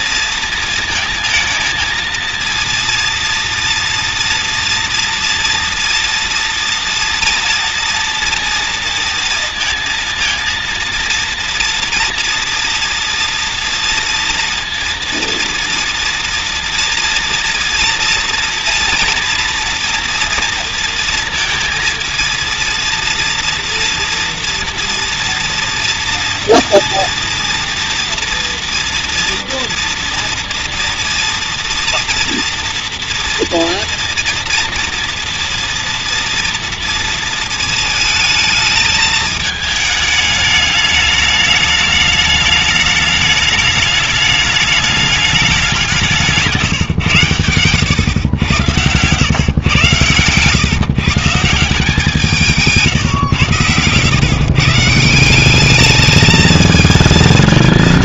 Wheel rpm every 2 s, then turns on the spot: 230, 230, 230, 230, 230, 230, 230, 230, 230, 230, 240, 230, 230, 230, 230, 230, 230, 230, 230, 220, 210, 210, 210, 150, 110, 130, 160, 140, 220.
46-50